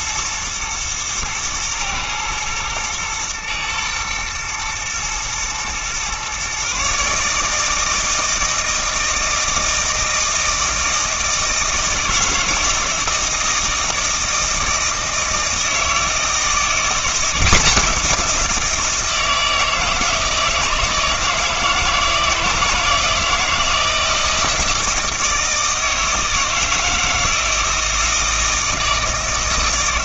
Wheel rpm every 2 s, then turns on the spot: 110, 110, 120, 140, 160, 160, 160, 160, 170, 170, 160, 160, 160, 160, 160.
none